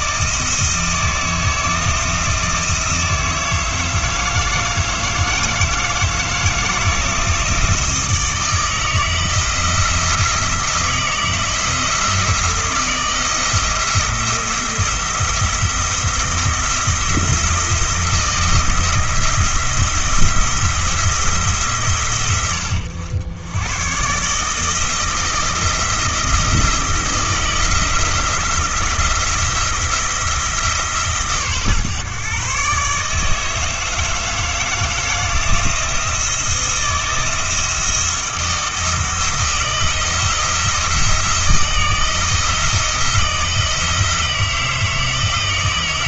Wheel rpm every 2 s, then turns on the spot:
160, 160, 160, 160, 160, 160, 170, 170, 170, 170, 170, 100, 160, 160, 170, 160, 140, 160, 160, 160, 170, 170, 160.
none